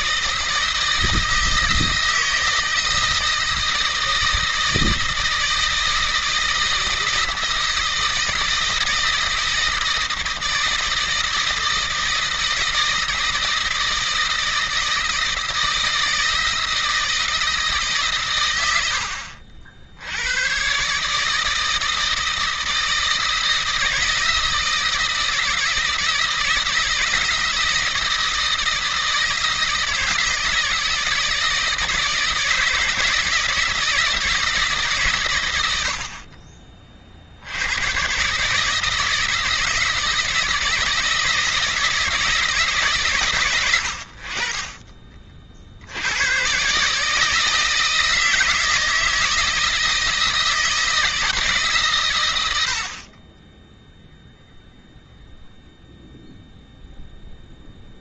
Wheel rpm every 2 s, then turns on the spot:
160, 160, 160, 160, 160, 160, 160, 160, 160, 90, 120, 160, 160, 160, 160, 160, 160, 150, 40, 150, 160, 150, 30, 120, 160, 160, 70, 0, 0.
none